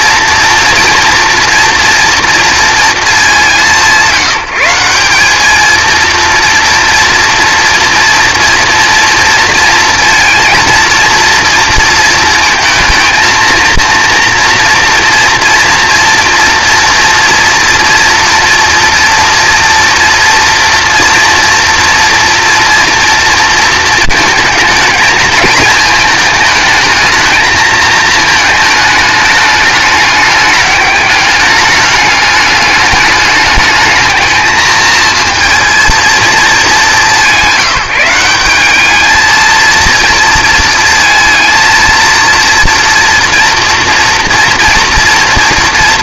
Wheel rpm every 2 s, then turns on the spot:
240, 230, 180, 230, 230, 230, 230, 240, 230, 240, 230, 230, 220, 220, 210, 210, 210, 220, 210, 200, 230, 230, 230.
none